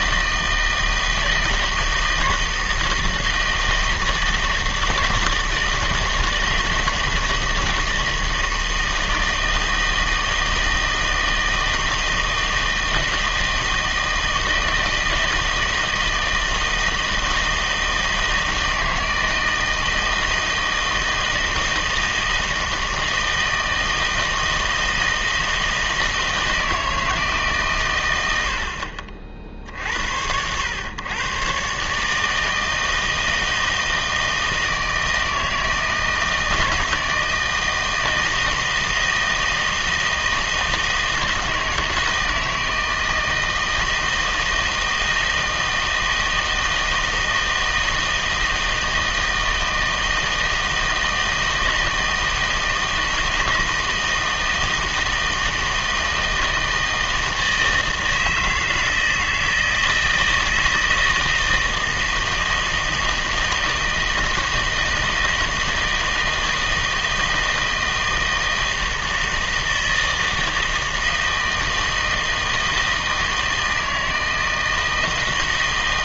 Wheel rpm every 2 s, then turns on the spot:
160, 160, 160, 160, 160, 160, 160, 160, 160, 160, 160, 160, 160, 160, 70, 90, 160, 160, 160, 160, 160, 160, 170, 160, 160, 160, 160, 160, 160, 160, 160, 160, 160, 160, 160, 160, 160, 160.
none